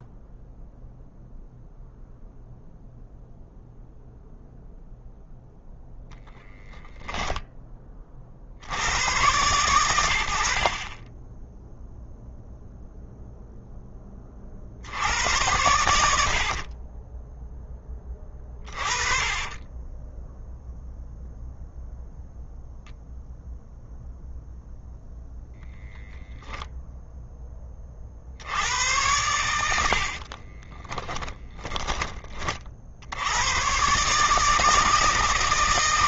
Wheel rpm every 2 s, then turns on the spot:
0, 0, 0, 0, 60, 60, 0, 50, 60, 20, 0, 0, 0, 0, 80, 30, 30, 150.
16-20 30-32